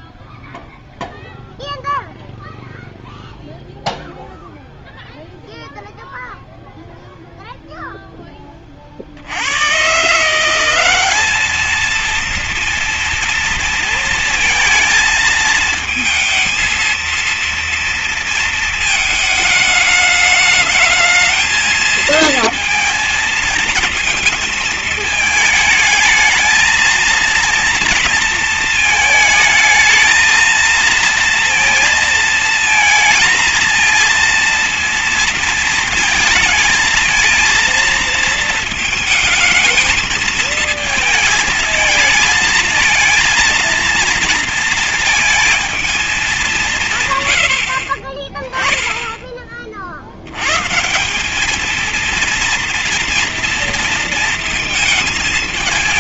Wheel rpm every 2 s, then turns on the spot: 0, 0, 0, 0, 30, 180, 230, 230, 230, 220, 210, 220, 220, 230, 220, 220, 230, 230, 220, 230, 220, 230, 230, 180, 20, 130, 230, 220.
none